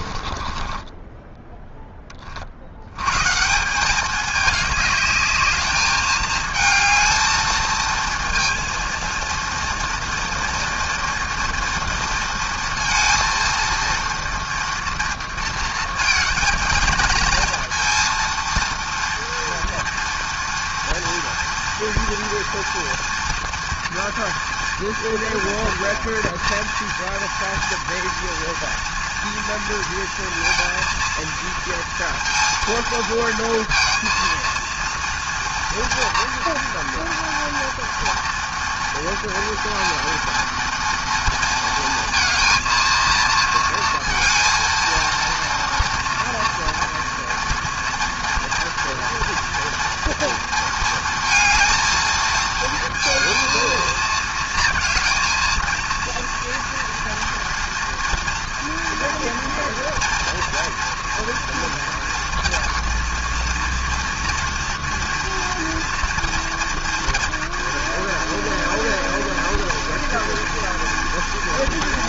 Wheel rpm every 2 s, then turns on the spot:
20, 90, 210, 220, 230, 230, 230, 230, 220, 230, 230, 230, 230, 230, 240, 230, 230, 230, 240, 230, 230, 230, 230, 230, 230, 230, 230, 230, 230, 230, 230, 230, 230, 230, 230, 230.
0-2